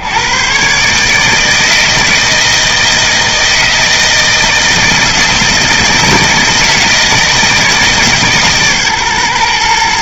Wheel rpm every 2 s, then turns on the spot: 140, 160, 160, 160, 140.
none